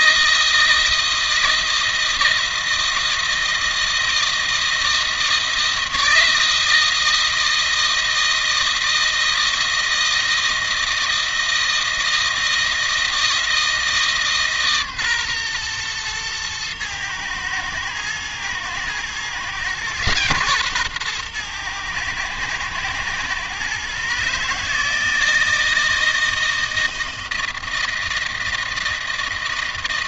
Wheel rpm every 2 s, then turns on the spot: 160, 160, 160, 160, 160, 160, 160, 150, 120, 120, 130, 110, 150, 160, 160.
none